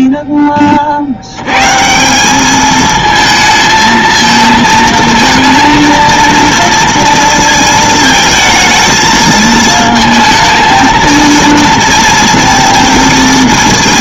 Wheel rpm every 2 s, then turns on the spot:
40, 220, 230, 230, 220, 220, 230.
none